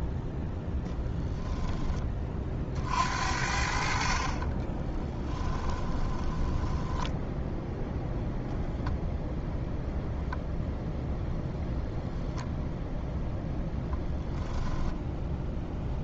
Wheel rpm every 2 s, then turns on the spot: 0, 50, 20, 10, 0, 0, 0, 0.
4-8